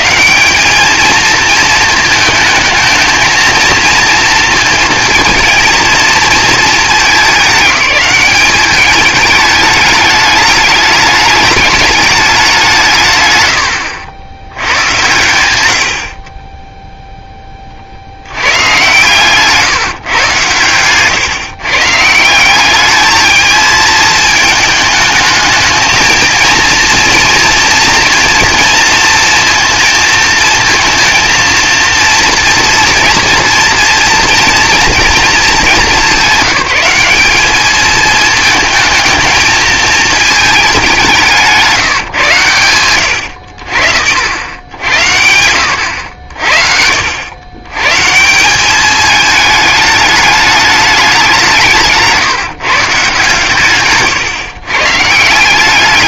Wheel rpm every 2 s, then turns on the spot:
200, 220, 230, 210, 200, 210, 170, 90, 10, 120, 120, 210, 220, 230, 230, 230, 240, 230, 190, 220, 200, 110, 90, 60, 190, 210, 160, 140.
none